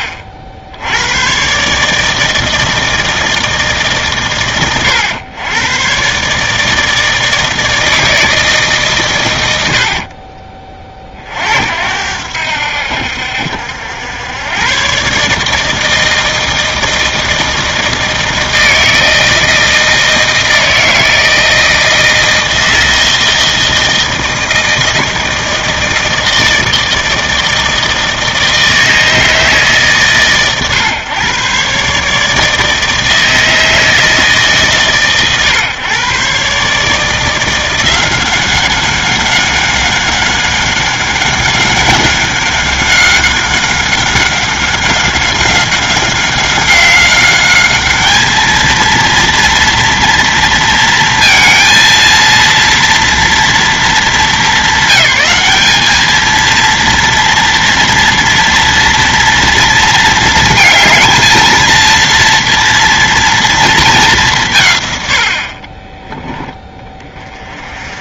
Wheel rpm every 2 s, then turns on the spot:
60, 160, 110, 160, 130, 30, 70, 130, 160, 160, 160, 160, 160, 160, 160, 130, 160, 140, 150, 190, 190, 190, 190, 190, 230, 230, 230, 200, 230, 230, 230, 230, 170, 20.
none